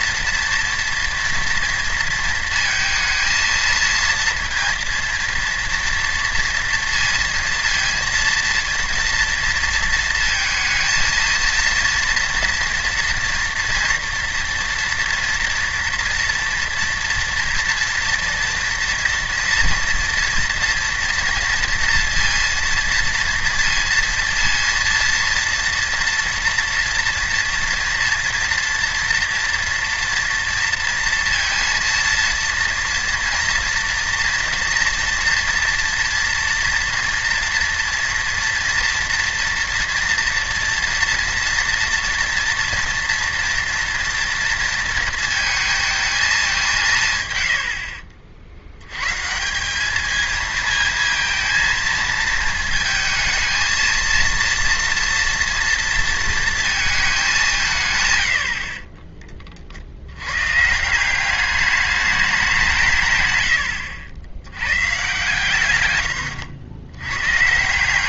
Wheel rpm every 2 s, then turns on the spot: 230, 230, 230, 230, 230, 230, 230, 230, 230, 230, 230, 230, 230, 230, 230, 230, 240, 240, 230, 230, 230, 230, 230, 200, 70, 220, 230, 230, 220, 70, 140, 180, 120, 90.
58-60